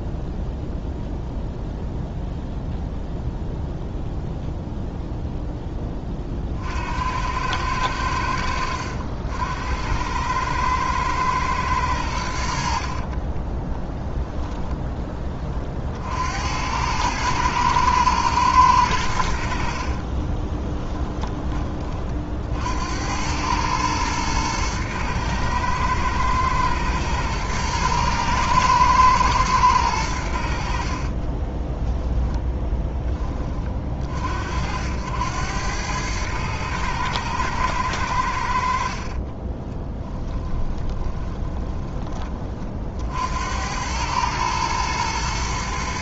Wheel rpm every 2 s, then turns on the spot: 0, 0, 0, 70, 80, 110, 50, 10, 100, 100, 10, 80, 110, 110, 110, 40, 10, 80, 110, 50, 20, 70, 110.
12-14 20-22 30-32 38-42